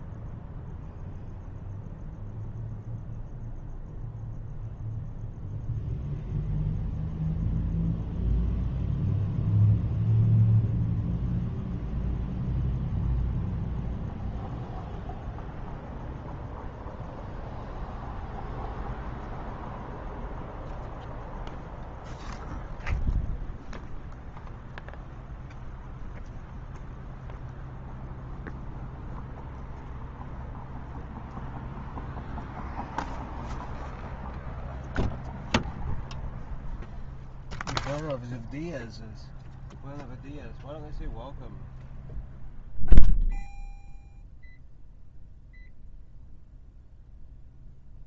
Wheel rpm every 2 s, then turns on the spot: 0, 0, 0, 0, 0, 0, 0, 0, 0, 0, 0, 0, 0, 0, 0, 0, 0, 0, 0, 0, 0, 0, 0, 0.
none